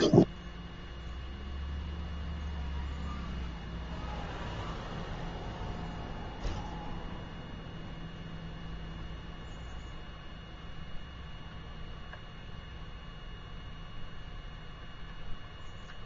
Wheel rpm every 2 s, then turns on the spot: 0, 0, 0, 0, 0, 0, 0, 0.
none